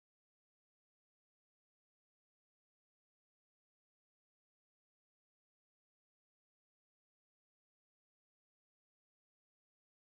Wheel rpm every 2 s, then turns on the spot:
0, 0, 0, 0, 0.
none